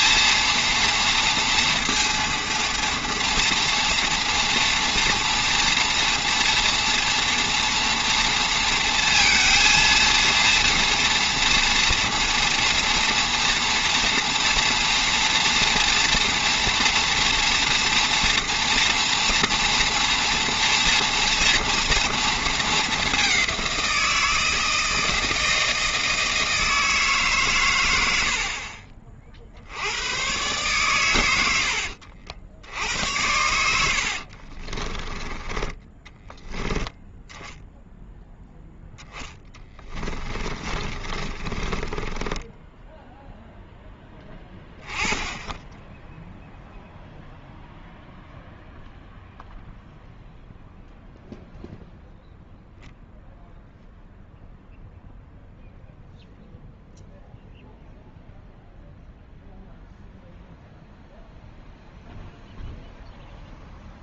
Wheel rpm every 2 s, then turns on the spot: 230, 230, 240, 240, 230, 230, 230, 230, 240, 230, 230, 230, 160, 160, 60, 120, 70, 40, 10, 0, 30, 10, 20, 0, 0, 0, 0, 0, 0, 0, 0, 0.
34-36 40-44